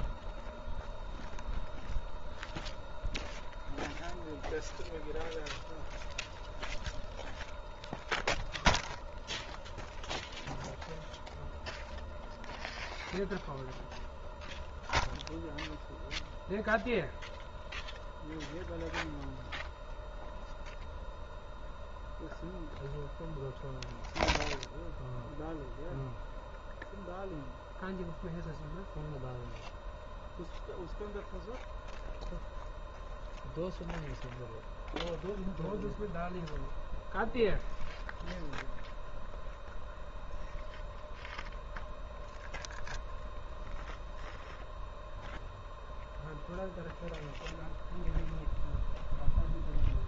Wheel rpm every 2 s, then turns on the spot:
0, 0, 0, 0, 0, 0, 0, 0, 0, 0, 0, 0, 0, 0, 0, 0, 0, 0, 0, 0, 0, 10, 0, 0, 0.
none